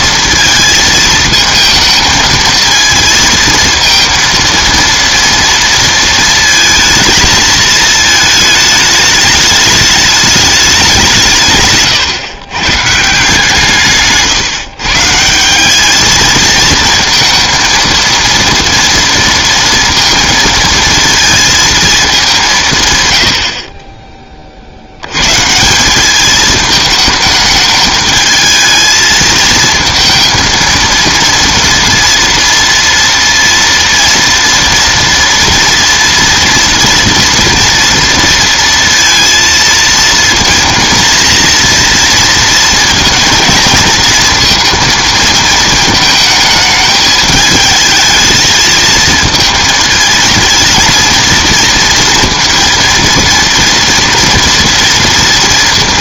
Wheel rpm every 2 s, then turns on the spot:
220, 220, 230, 220, 210, 200, 150, 150, 220, 230, 220, 140, 100, 220, 220, 230, 230, 230, 230, 230, 230, 230, 230, 210, 220, 230, 230, 230.
none